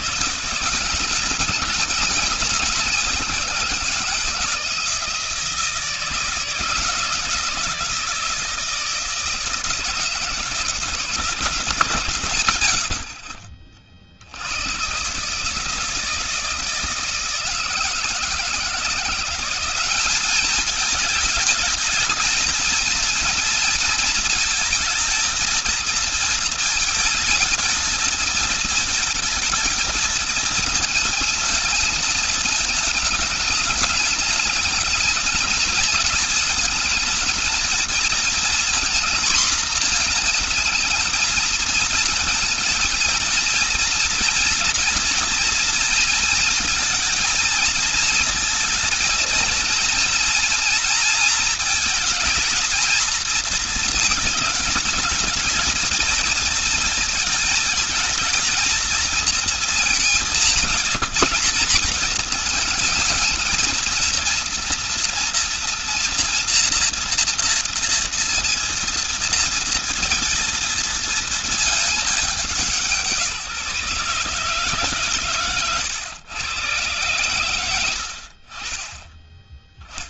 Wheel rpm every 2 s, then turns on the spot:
160, 190, 160, 160, 160, 170, 130, 120, 160, 170, 220, 230, 220, 220, 220, 230, 220, 220, 220, 230, 220, 230, 240, 220, 230, 230, 220, 220, 230, 230, 190, 220, 230, 240, 230, 220, 170, 140, 120, 50.
12-14